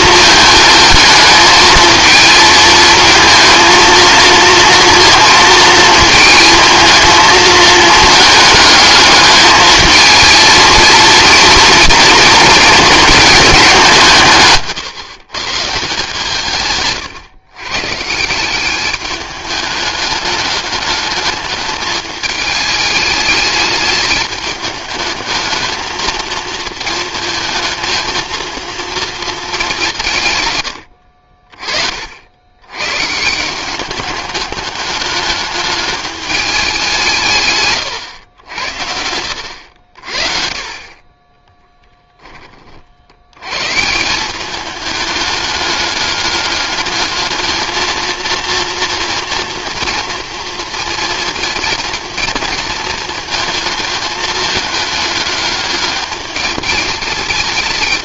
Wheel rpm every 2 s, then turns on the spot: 220, 230, 230, 220, 210, 230, 220, 170, 160, 190, 210, 210, 210, 230, 230, 110, 100, 210, 200, 90, 40, 40, 200, 210, 220, 230, 230, 220, 210.
none